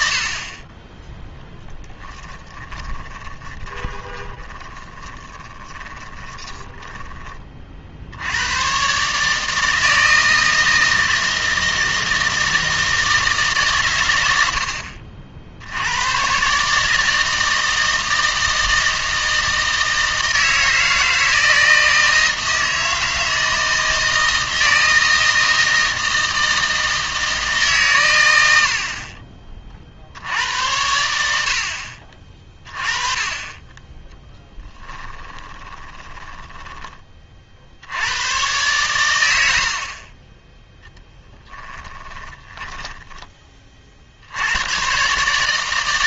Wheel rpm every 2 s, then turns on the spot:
20, 10, 20, 10, 130, 160, 160, 70, 150, 160, 160, 160, 160, 160, 70, 100, 30, 20, 10, 120, 10, 10, 110.
2-8 34-36 42-44